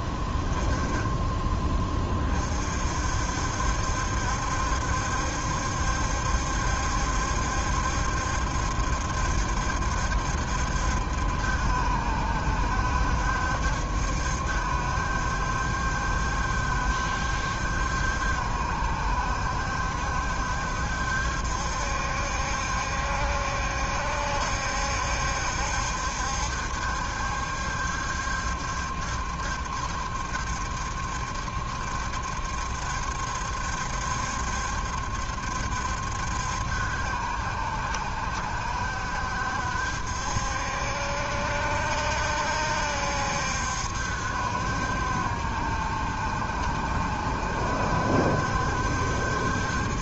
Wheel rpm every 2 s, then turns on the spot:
10, 40, 70, 70, 70, 70, 70, 70, 70, 70, 70, 70, 70, 70, 70, 70, 70, 70, 70, 70, 70, 70, 70, 70, 70.
none